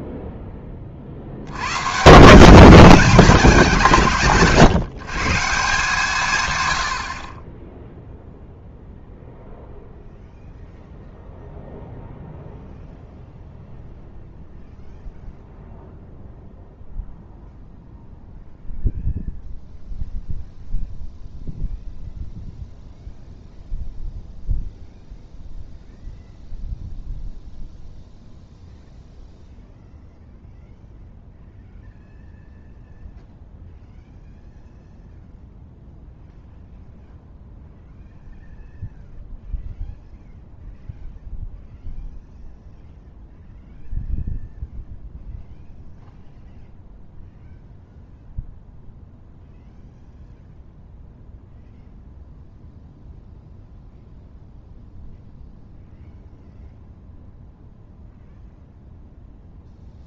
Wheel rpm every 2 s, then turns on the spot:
20, 180, 150, 100, 0, 0, 0, 0, 0, 0, 0, 0, 0, 0, 0, 0, 0, 0, 0, 0, 0, 0, 0, 0, 0, 0, 0, 0, 0, 0.
none